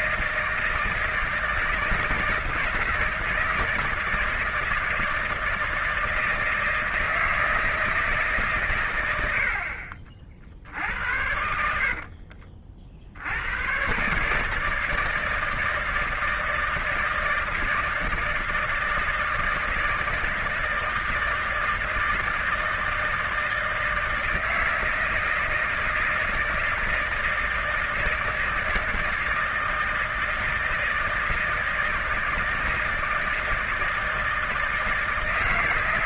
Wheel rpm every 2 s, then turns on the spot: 160, 170, 160, 160, 100, 60, 50, 160, 160, 160, 160, 160, 160, 160, 160, 160, 160, 160.
none